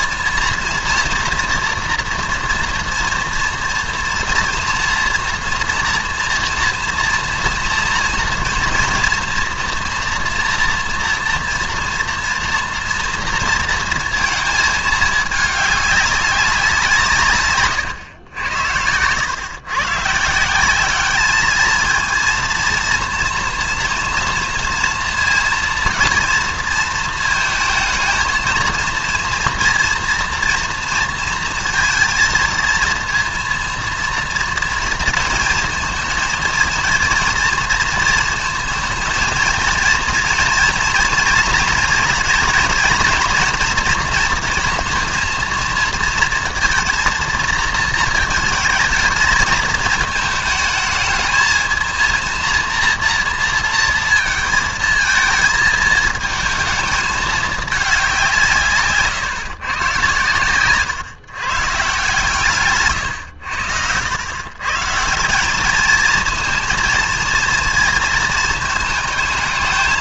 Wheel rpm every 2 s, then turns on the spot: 230, 230, 230, 230, 230, 230, 230, 220, 180, 100, 190, 230, 230, 230, 230, 230, 230, 220, 230, 230, 230, 230, 230, 220, 220, 220, 230, 220, 220, 150, 120, 150, 140, 230, 220.
none